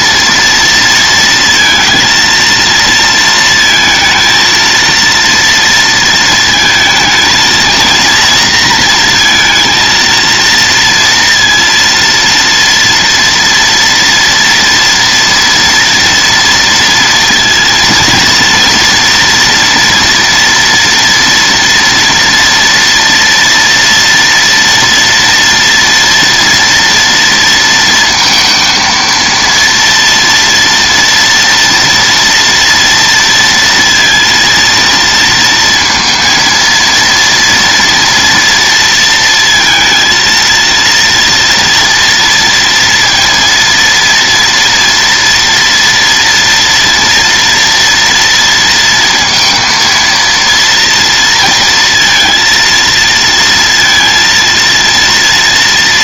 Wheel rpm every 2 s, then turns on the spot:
230, 230, 230, 220, 230, 230, 230, 240, 230, 230, 240, 230, 230, 230, 230, 230, 230, 230, 230, 230, 230, 230, 240, 230, 230, 230, 230, 230.
none